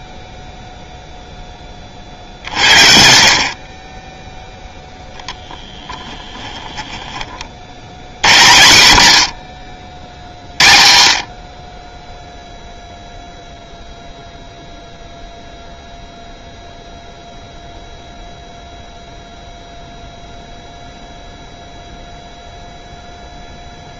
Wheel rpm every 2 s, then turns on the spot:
0, 60, 0, 20, 90, 50, 0, 0, 0, 0, 0, 0.
6-8